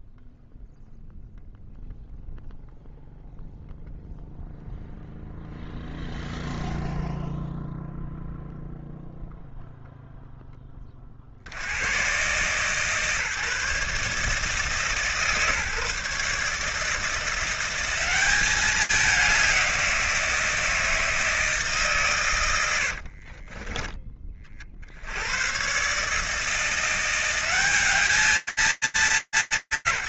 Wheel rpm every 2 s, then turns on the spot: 0, 0, 0, 0, 0, 90, 140, 150, 170, 180, 150, 20, 90, 180, 220.
22-24